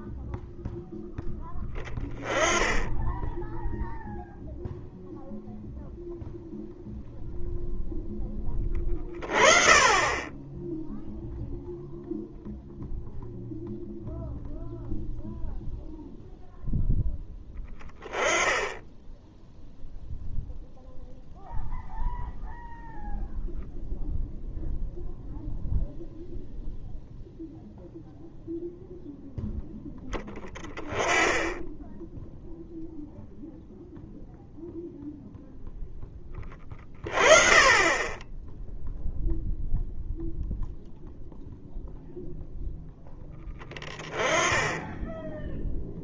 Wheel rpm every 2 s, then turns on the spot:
0, 10, 0, 0, 20, 0, 0, 0, 10, 10, 0, 0, 0, 0, 0, 20, 0, 0, 30, 0, 0, 0, 10.
none